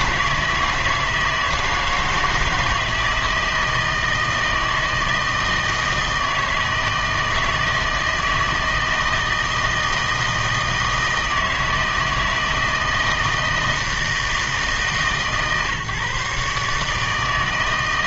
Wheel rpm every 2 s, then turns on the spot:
160, 160, 160, 160, 160, 160, 160, 160, 150.
none